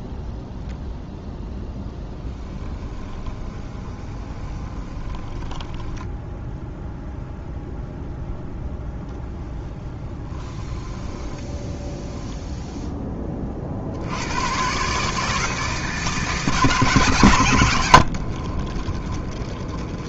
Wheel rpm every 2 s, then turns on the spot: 0, 10, 20, 0, 0, 10, 0, 130, 140, 20.
2-6 10-12 18-20